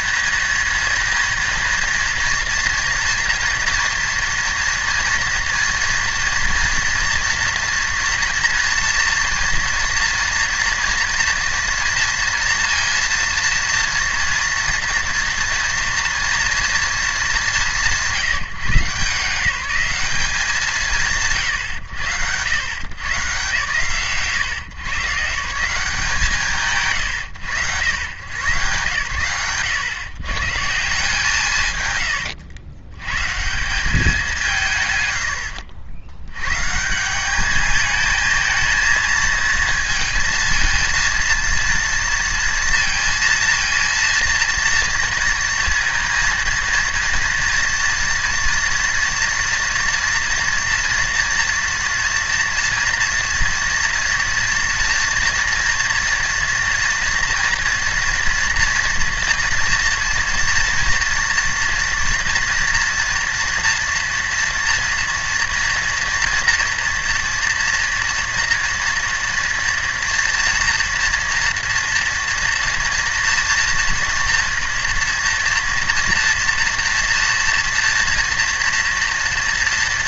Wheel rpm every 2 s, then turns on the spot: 230, 230, 230, 230, 240, 230, 230, 230, 230, 170, 150, 90, 120, 130, 90, 130, 100, 170, 110, 220, 230, 230, 230, 230, 230, 230, 230, 230, 230, 230, 230, 230, 230, 230, 230, 230, 230, 230, 230, 230.
none